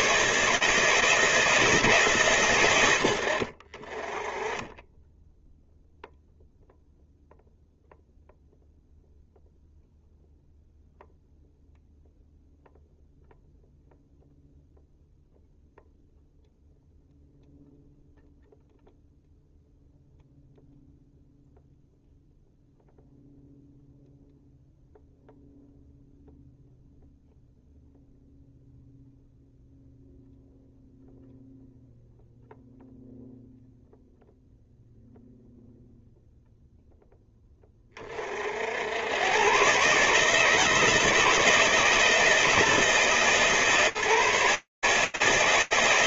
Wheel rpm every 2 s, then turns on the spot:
160, 60, 0, 0, 0, 0, 0, 0, 0, 0, 0, 0, 0, 0, 0, 0, 0, 0, 10, 90, 160, 160, 140.
none